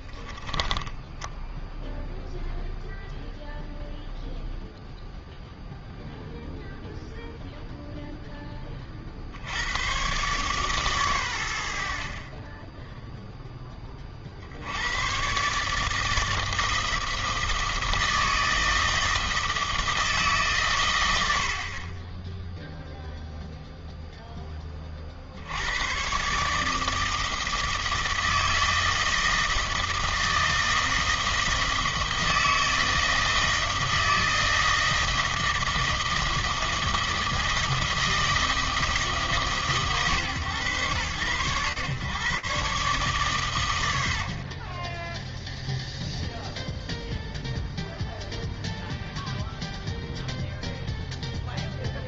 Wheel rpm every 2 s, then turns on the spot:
10, 0, 0, 0, 70, 100, 10, 140, 160, 160, 50, 0, 110, 160, 160, 160, 160, 160, 160, 140, 130, 80, 0, 0, 0, 0.
0-2